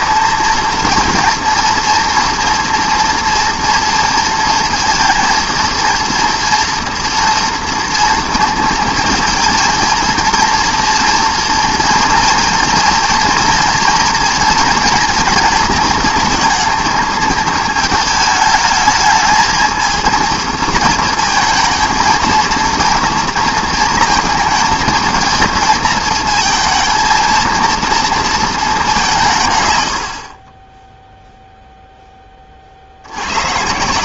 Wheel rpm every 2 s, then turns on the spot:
230, 230, 230, 230, 230, 230, 230, 230, 220, 220, 230, 220, 230, 230, 90, 0, 120.
none